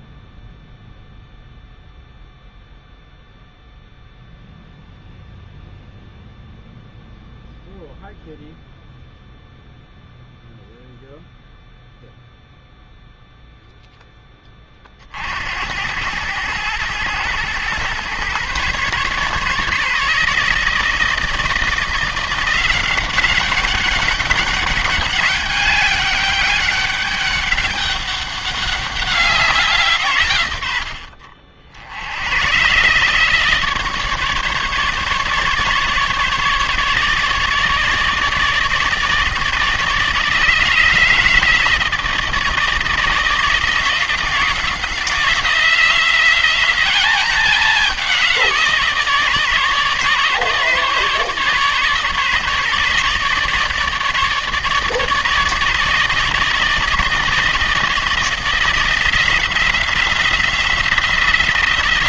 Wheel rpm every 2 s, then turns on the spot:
0, 0, 0, 0, 0, 0, 0, 30, 110, 130, 160, 180, 200, 200, 200, 90, 120, 150, 150, 150, 160, 160, 170, 190, 170, 150, 150, 150, 160, 170, 180.
none